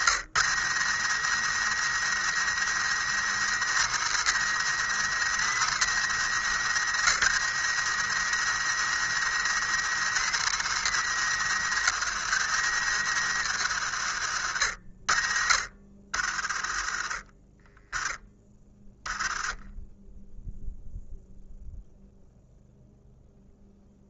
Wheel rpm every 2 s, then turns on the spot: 100, 110, 120, 100, 110, 120, 100, 60, 30, 10, 0, 0.
none